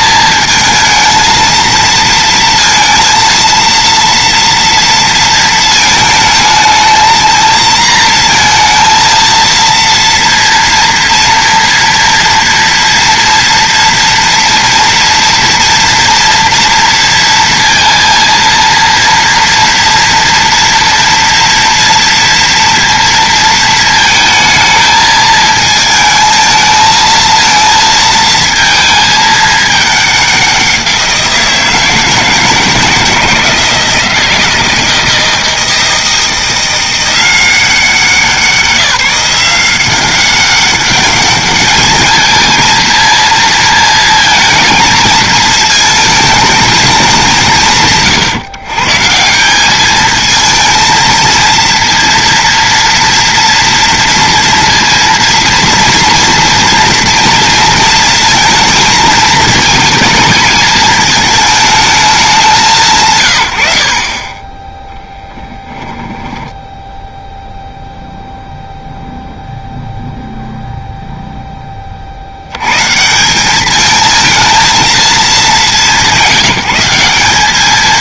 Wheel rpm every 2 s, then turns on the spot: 220, 230, 240, 220, 230, 230, 230, 230, 230, 230, 230, 230, 220, 220, 220, 180, 160, 160, 170, 180, 200, 230, 230, 220, 140, 220, 230, 230, 230, 230, 220, 170, 10, 10, 0, 0, 110, 220, 170.
64-68